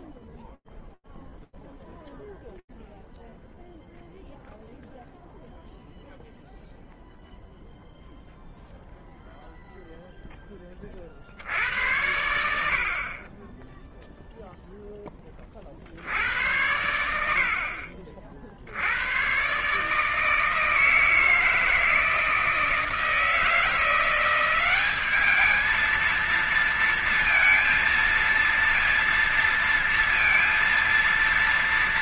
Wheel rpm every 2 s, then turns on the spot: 0, 0, 0, 0, 0, 40, 40, 20, 70, 100, 160, 160, 200, 230, 230, 230.
none